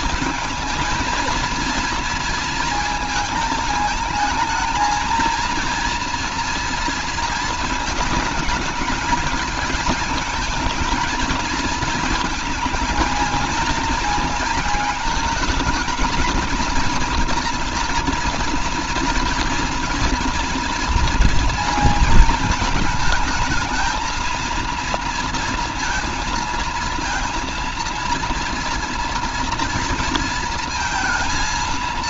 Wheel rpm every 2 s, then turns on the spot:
230, 230, 230, 230, 210, 220, 230, 230, 230, 230, 230, 220, 230, 230, 230, 230.
none